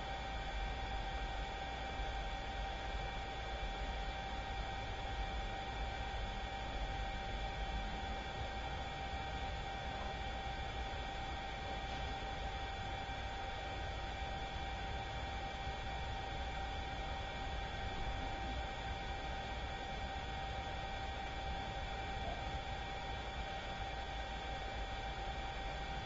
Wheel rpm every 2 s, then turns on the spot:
0, 0, 0, 0, 0, 0, 0, 0, 0, 0, 0, 0, 0.
none